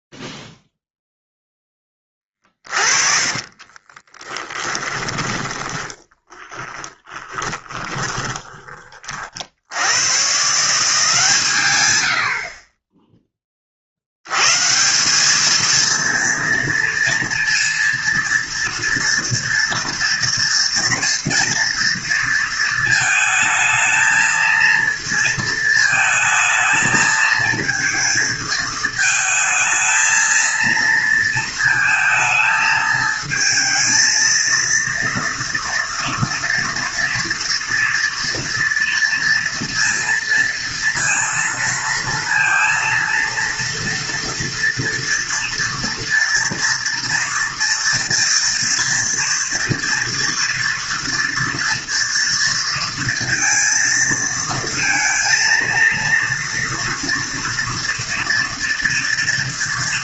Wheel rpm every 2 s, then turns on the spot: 0, 30, 20, 20, 20, 160, 40, 130, 230, 230, 240, 230, 230, 220, 220, 230, 220, 230, 230, 230, 230, 230, 230, 230, 240, 230, 230, 230, 230, 230.
2-8